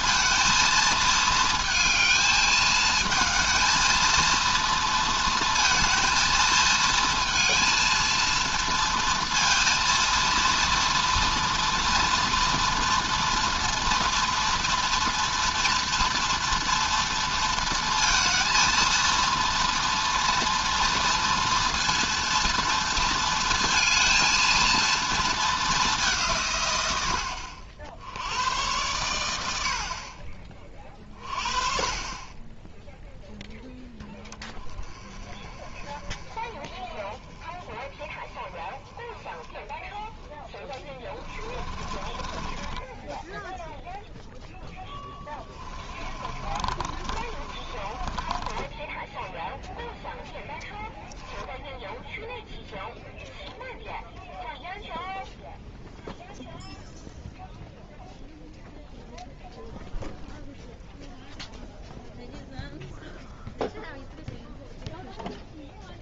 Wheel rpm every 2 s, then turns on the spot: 230, 220, 230, 230, 230, 240, 230, 230, 230, 230, 240, 230, 230, 110, 90, 30, 10, 20, 20, 20, 10, 10, 10, 30, 10, 0, 0, 0, 0, 0, 0, 0, 0.
40-50